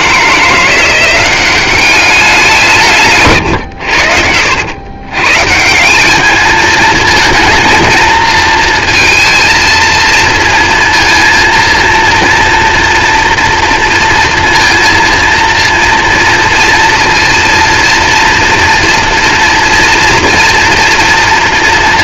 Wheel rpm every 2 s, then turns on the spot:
170, 150, 110, 220, 230, 230, 230, 230, 240, 240, 230.
none